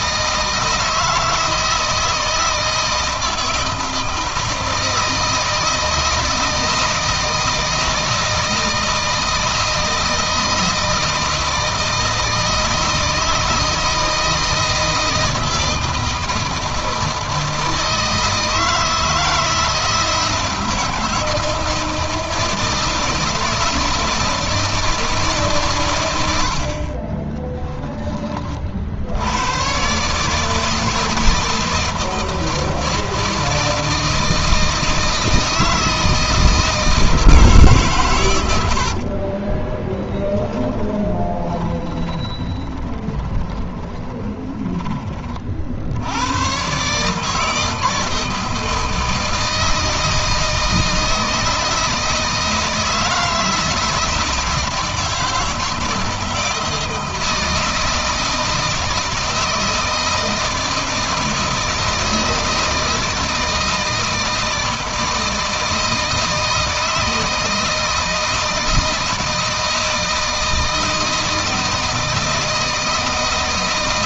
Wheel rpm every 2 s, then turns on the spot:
160, 160, 160, 160, 160, 160, 160, 160, 160, 160, 160, 160, 160, 50, 60, 160, 160, 160, 160, 70, 10, 10, 20, 130, 160, 160, 160, 160, 160, 160, 160, 160, 160, 160, 160, 160, 160.
38-44